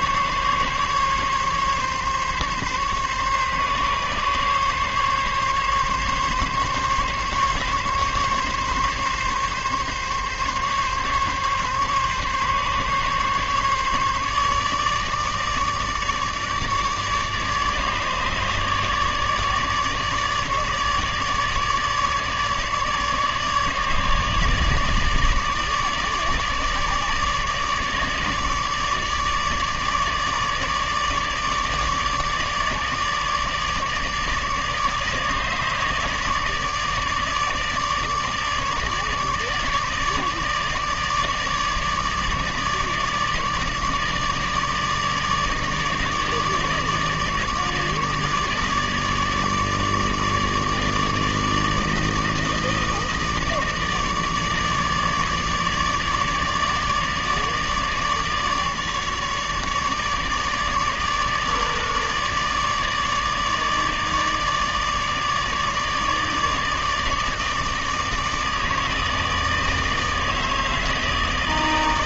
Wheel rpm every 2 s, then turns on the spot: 140, 140, 140, 140, 140, 140, 140, 150, 150, 150, 150, 150, 150, 150, 150, 150, 150, 150, 160, 150, 150, 150, 150, 150, 150, 150, 160, 150, 150, 150, 150, 150, 150, 150, 160, 160.
none